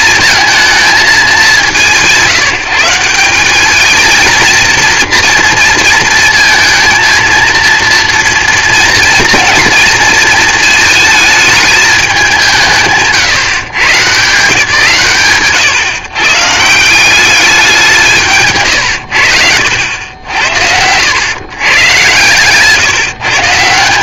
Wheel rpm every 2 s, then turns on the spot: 220, 170, 230, 230, 240, 230, 160, 140, 140, 140, 80, 140.
none